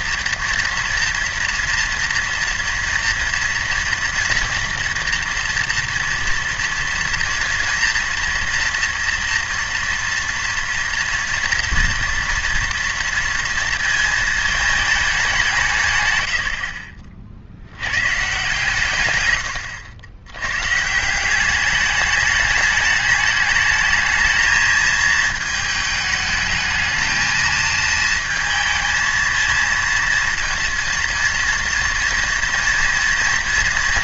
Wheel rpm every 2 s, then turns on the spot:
240, 230, 230, 230, 230, 230, 230, 210, 60, 130, 120, 210, 220, 220, 220, 230, 230.
16-18